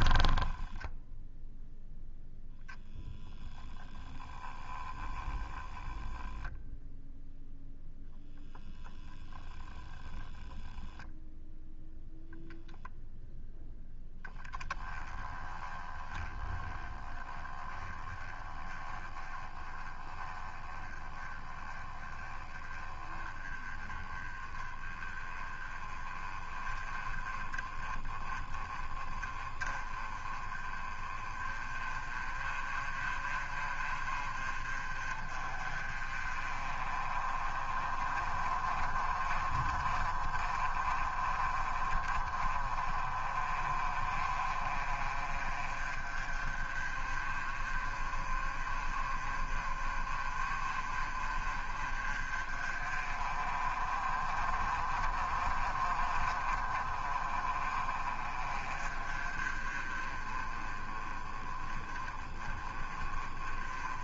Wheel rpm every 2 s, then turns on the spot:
10, 10, 10, 0, 0, 0, 0, 10, 20, 20, 20, 20, 20, 20, 20, 30, 30, 30, 30, 30, 30, 30, 30, 30, 30, 40, 30, 30, 40, 30, 30, 30.
none